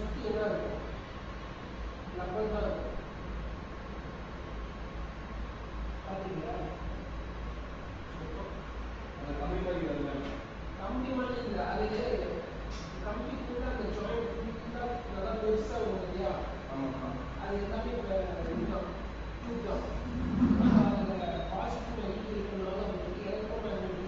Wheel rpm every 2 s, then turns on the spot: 0, 0, 0, 0, 0, 0, 0, 0, 0, 0, 0, 0.
none